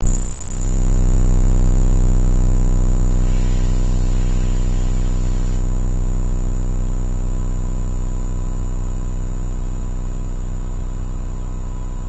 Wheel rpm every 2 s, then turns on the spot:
0, 0, 0, 0, 0, 0.
none